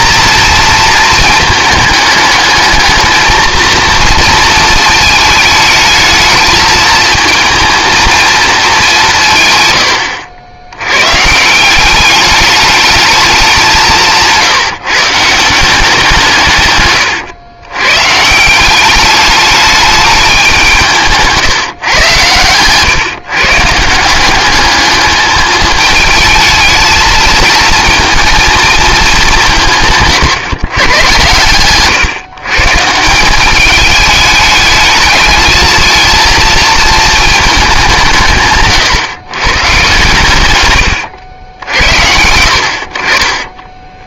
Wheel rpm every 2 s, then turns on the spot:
240, 220, 230, 230, 220, 100, 210, 150, 150, 180, 180, 120, 200, 220, 220, 120, 150, 210, 230, 130, 110, 60.
none